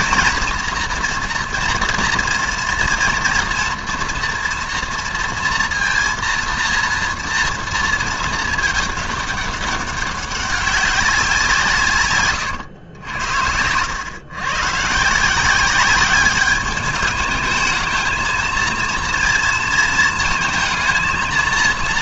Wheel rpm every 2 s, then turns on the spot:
240, 230, 230, 230, 220, 200, 120, 130, 210, 230, 220.
12-14